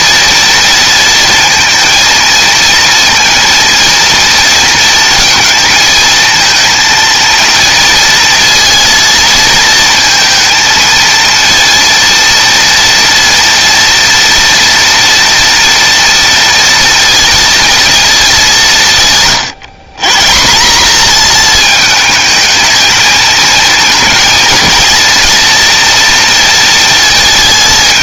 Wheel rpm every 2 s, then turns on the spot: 230, 230, 230, 230, 230, 230, 230, 230, 230, 200, 150, 220, 230, 230.
none